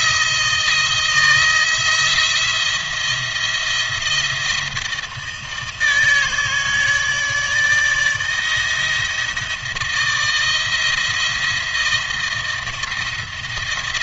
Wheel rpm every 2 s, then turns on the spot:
160, 170, 160, 160, 160, 160, 170.
none